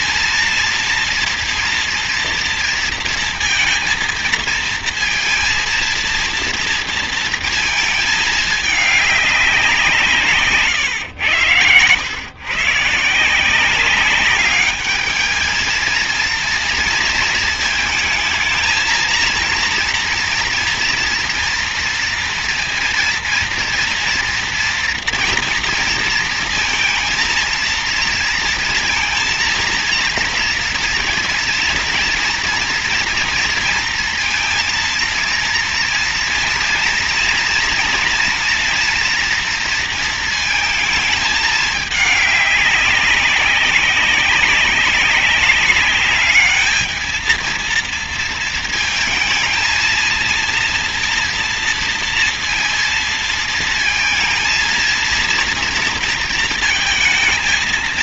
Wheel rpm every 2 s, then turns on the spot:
230, 230, 230, 230, 210, 110, 160, 210, 230, 220, 230, 230, 240, 230, 230, 230, 230, 230, 230, 230, 220, 200, 200, 220, 220, 230, 230, 230, 220.
none